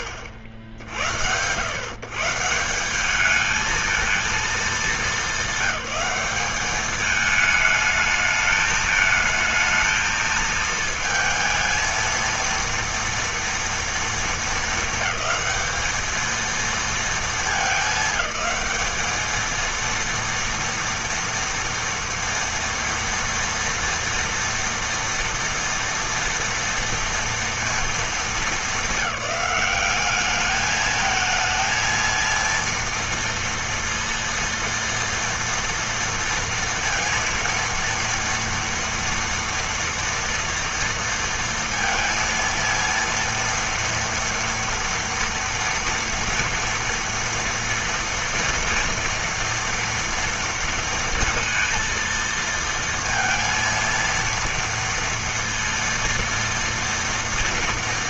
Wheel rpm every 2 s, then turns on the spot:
60, 200, 210, 210, 220, 220, 230, 220, 220, 220, 240, 230, 230, 230, 210, 220, 230, 230, 230, 230, 230, 230, 230, 230, 230, 230, 230, 230, 230.
none